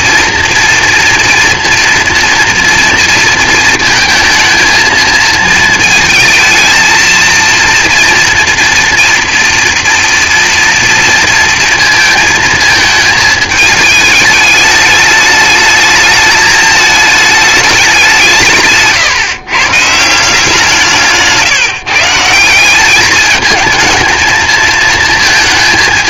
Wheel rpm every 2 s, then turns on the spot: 230, 240, 230, 220, 230, 230, 220, 210, 210, 160, 170, 190, 230.
none